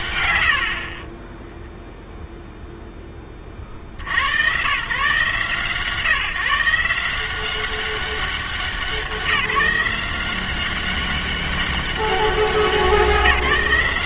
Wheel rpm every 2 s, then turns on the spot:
80, 0, 130, 160, 190, 190, 180.
none